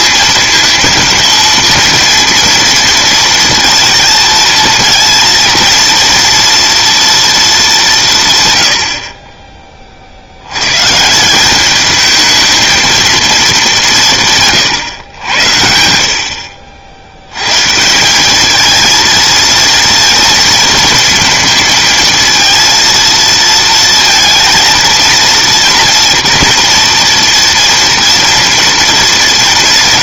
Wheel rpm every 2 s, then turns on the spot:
230, 240, 230, 230, 70, 120, 220, 120, 80, 220, 230, 230, 230, 240, 220.
none